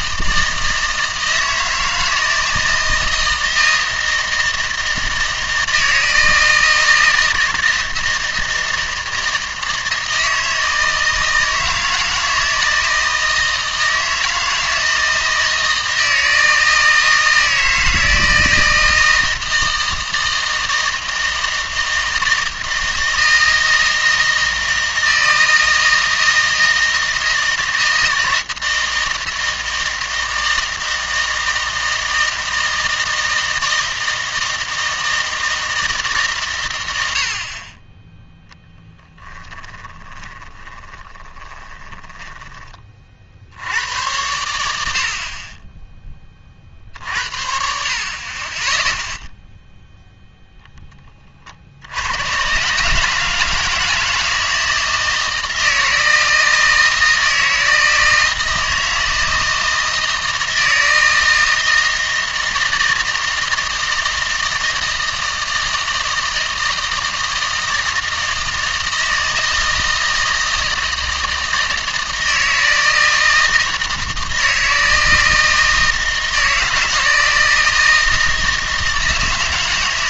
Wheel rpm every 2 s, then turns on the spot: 160, 160, 160, 160, 160, 160, 160, 160, 160, 160, 160, 160, 160, 160, 160, 160, 160, 160, 110, 0, 20, 30, 90, 50, 20, 10, 130, 160, 160, 160, 160, 160, 160, 160, 160, 160, 160, 160, 160, 160.
40-42